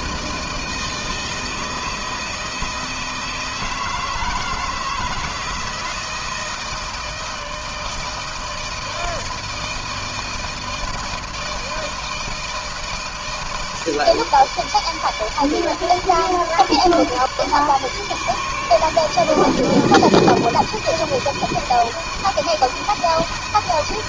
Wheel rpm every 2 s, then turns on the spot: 160, 160, 160, 160, 160, 160, 160, 150, 150, 150, 160, 160.
none